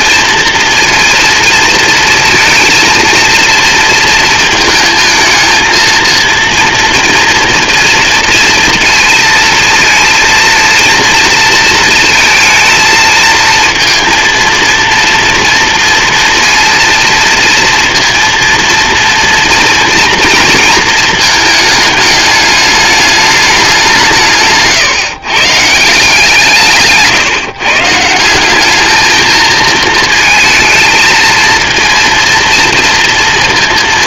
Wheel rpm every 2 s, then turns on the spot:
230, 230, 220, 230, 230, 230, 230, 230, 230, 230, 230, 210, 160, 160, 190, 220, 230.
24-26